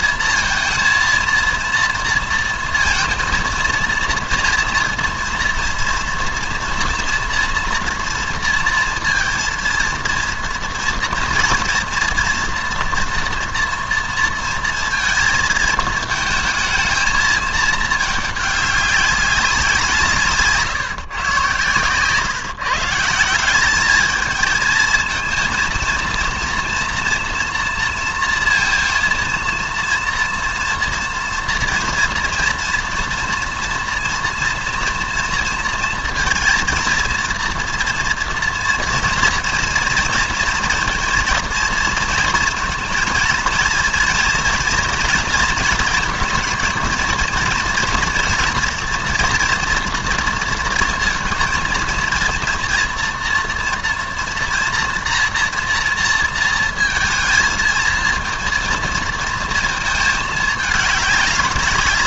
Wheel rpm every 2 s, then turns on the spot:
230, 230, 230, 230, 230, 230, 240, 230, 220, 200, 160, 150, 220, 230, 230, 230, 230, 230, 230, 230, 230, 230, 230, 230, 230, 230, 230, 240, 230, 230, 210.
none